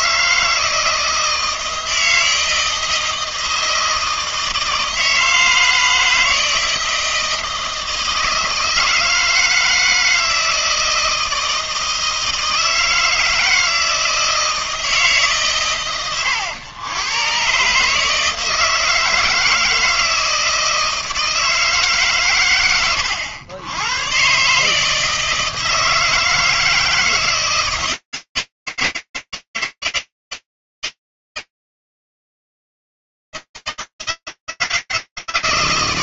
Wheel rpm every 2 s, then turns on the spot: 160, 160, 160, 160, 160, 160, 160, 160, 110, 160, 160, 110, 140, 160, 160, 160, 160, 160.
none